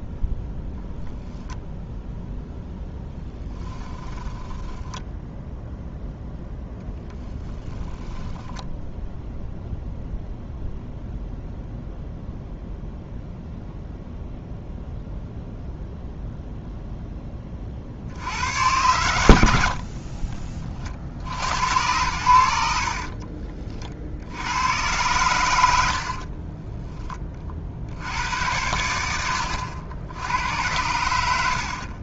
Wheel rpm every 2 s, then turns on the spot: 0, 0, 20, 0, 10, 0, 0, 0, 0, 90, 40, 70, 100, 20, 80, 90.
4-6 22-24 26-28